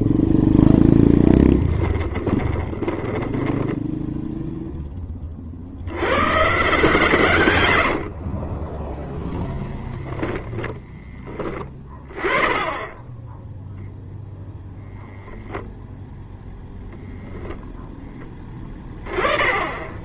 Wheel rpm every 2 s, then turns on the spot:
0, 20, 10, 140, 10, 10, 0, 0, 0, 20.
2-4 8-10